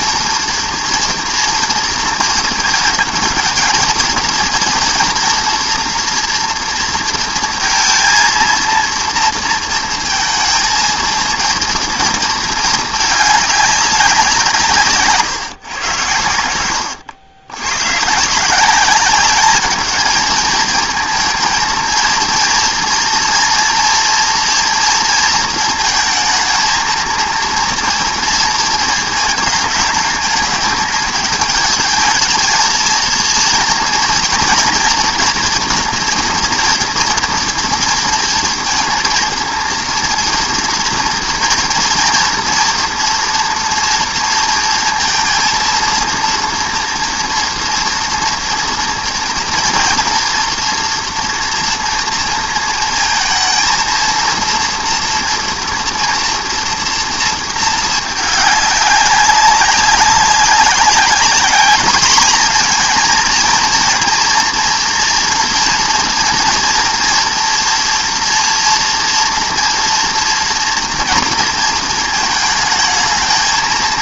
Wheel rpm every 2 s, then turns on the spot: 230, 220, 230, 230, 230, 230, 220, 150, 90, 190, 230, 230, 230, 220, 220, 210, 230, 240, 230, 230, 230, 230, 230, 230, 230, 240, 230, 230, 240, 200, 190, 230, 240, 230, 230, 240, 220.
16-18